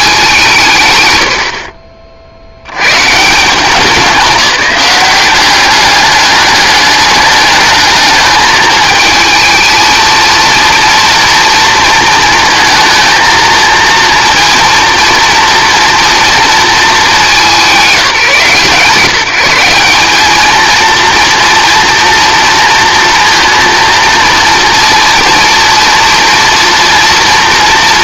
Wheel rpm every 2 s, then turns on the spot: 160, 90, 180, 200, 220, 230, 230, 230, 210, 150, 230, 230, 230, 230.
none